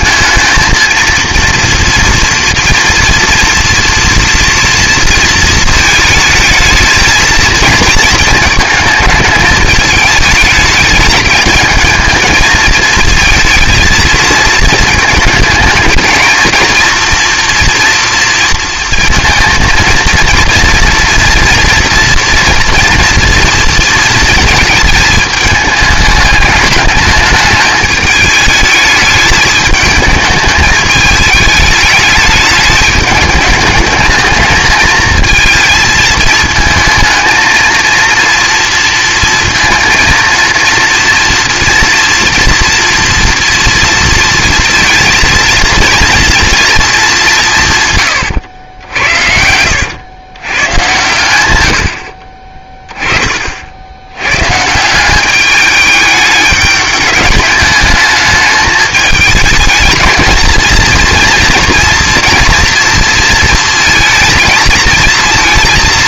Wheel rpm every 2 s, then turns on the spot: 230, 240, 230, 220, 220, 210, 220, 220, 230, 230, 230, 230, 220, 210, 210, 220, 210, 220, 220, 230, 230, 240, 230, 230, 100, 120, 20, 130, 210, 220, 230, 230, 230.
none